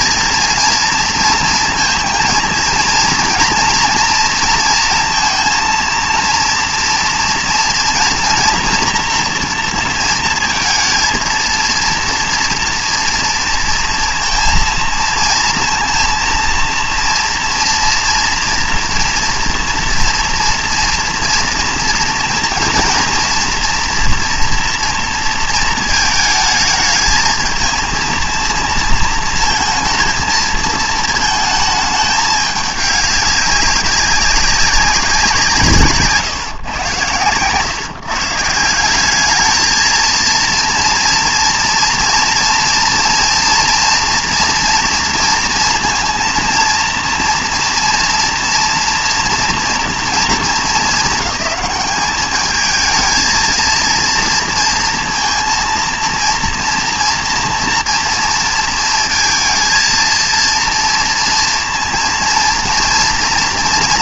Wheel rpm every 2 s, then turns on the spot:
230, 230, 230, 230, 230, 230, 230, 230, 230, 240, 240, 230, 240, 220, 230, 220, 210, 200, 120, 170, 230, 230, 230, 230, 230, 220, 210, 230, 230, 230, 230, 230.
none